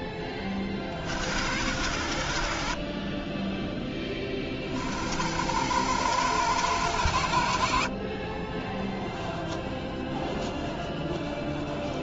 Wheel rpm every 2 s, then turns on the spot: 20, 50, 30, 60, 10, 10.
none